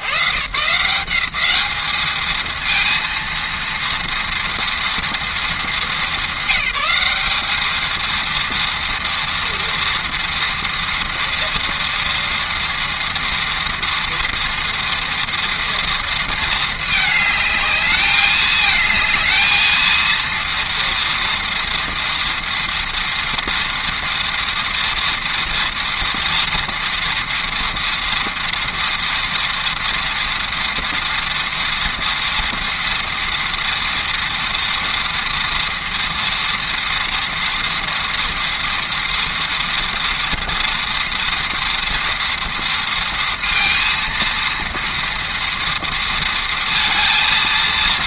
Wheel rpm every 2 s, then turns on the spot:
120, 230, 230, 190, 230, 230, 230, 230, 220, 220, 230, 230, 230, 230, 230, 230, 230, 230, 230, 230, 230, 230, 230, 230.
none